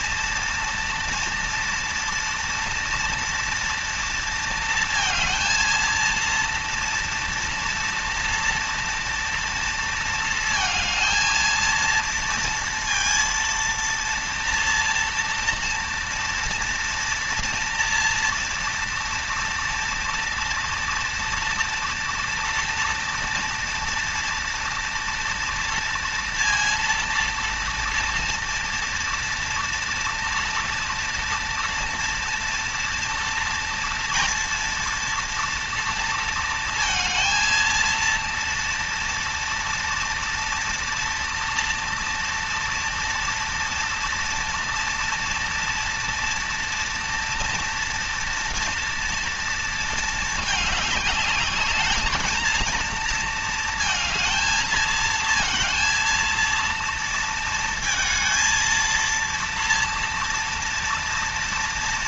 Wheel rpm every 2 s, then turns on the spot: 230, 230, 230, 230, 230, 230, 230, 230, 230, 240, 230, 230, 230, 230, 230, 230, 230, 230, 230, 230, 230, 230, 230, 230, 230, 210, 230, 220, 230, 230, 230.
none